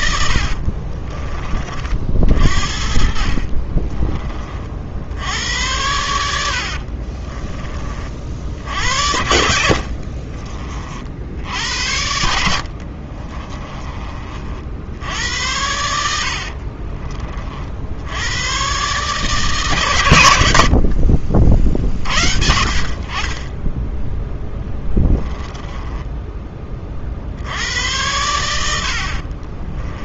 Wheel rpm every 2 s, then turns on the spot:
40, 50, 60, 50, 70, 50, 60, 70, 40, 140, 60, 50, 30, 30, 60.
0-4 6-8 12-14 16-18 24-26